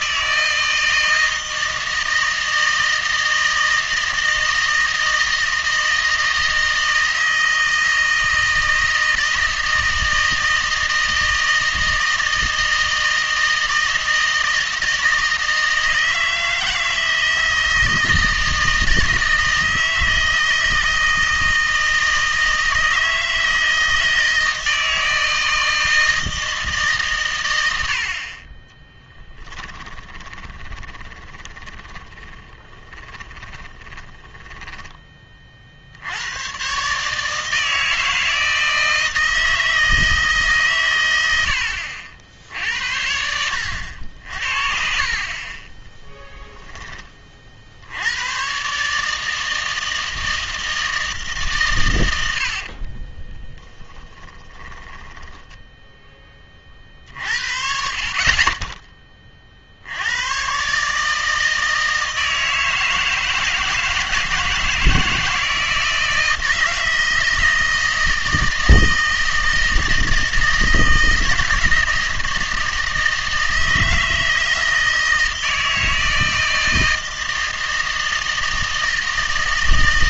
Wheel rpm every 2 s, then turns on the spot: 160, 160, 160, 160, 160, 160, 160, 160, 160, 160, 160, 160, 160, 150, 20, 20, 10, 20, 130, 160, 140, 70, 60, 10, 130, 160, 70, 20, 40, 20, 130, 160, 160, 160, 160, 160, 160, 160, 160, 160.
30-36 52-56